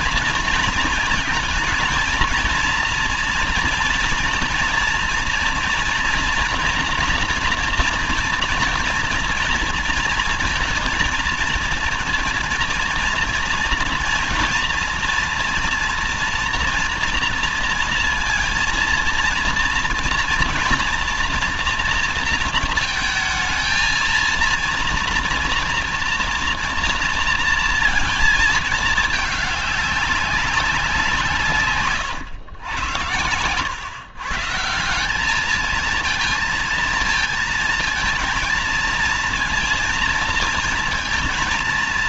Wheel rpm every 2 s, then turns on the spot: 230, 230, 230, 240, 230, 230, 240, 240, 230, 230, 230, 220, 230, 230, 220, 190, 100, 150, 230, 230, 230.
none